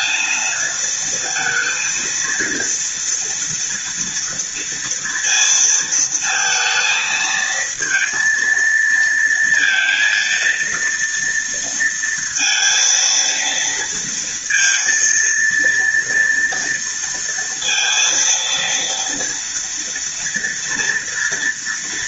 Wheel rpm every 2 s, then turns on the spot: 230, 230, 230, 230, 230, 230, 230, 230, 230, 230, 230.
none